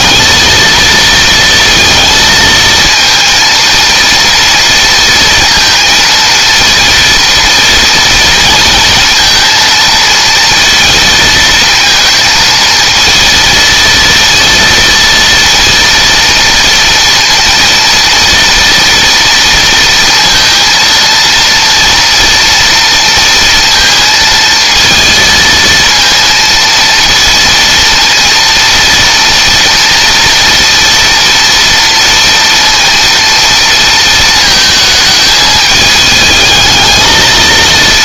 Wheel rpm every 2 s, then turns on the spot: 230, 230, 230, 230, 230, 230, 230, 230, 230, 230, 230, 230, 230, 230, 230, 230, 230, 220, 220.
none